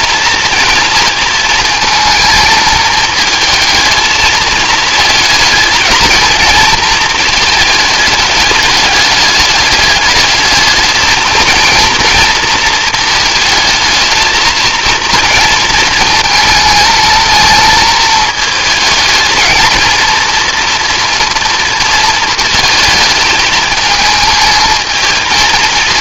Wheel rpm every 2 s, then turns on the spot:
230, 220, 220, 220, 210, 220, 230, 230, 220, 220, 240, 220, 220.
none